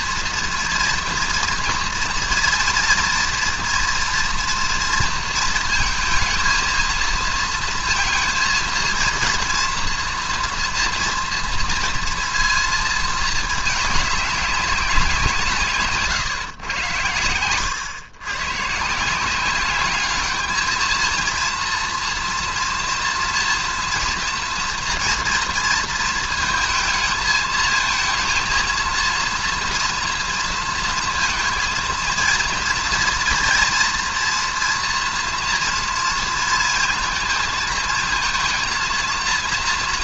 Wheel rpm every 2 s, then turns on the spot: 230, 230, 230, 230, 230, 230, 230, 200, 120, 130, 220, 230, 230, 220, 230, 230, 230, 230, 230, 230.
none